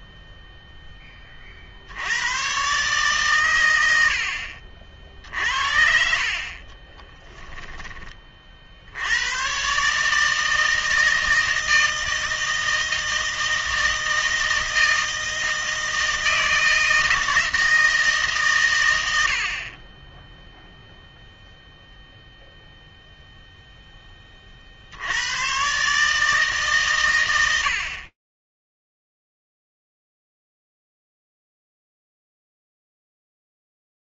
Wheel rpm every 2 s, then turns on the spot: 10, 130, 50, 30, 60, 160, 160, 160, 160, 120, 0, 0, 50, 140, 0, 0, 0.
6-8